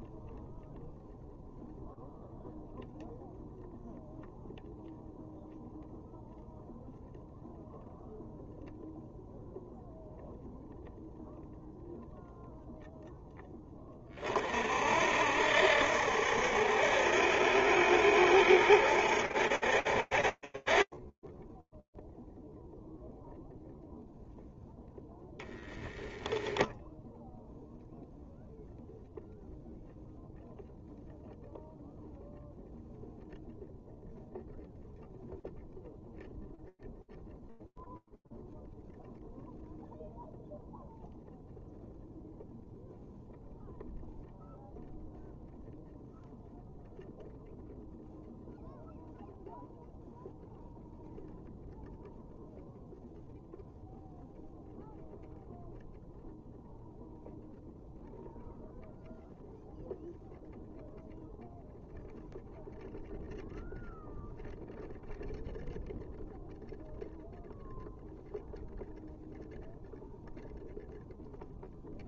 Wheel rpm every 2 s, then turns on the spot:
0, 0, 0, 0, 0, 0, 10, 60, 70, 60, 20, 0, 0, 0, 0, 0, 0, 0, 0, 0, 0, 0, 0, 0, 0, 0, 0, 0, 0, 0, 0, 0, 0, 0, 0, 0.
none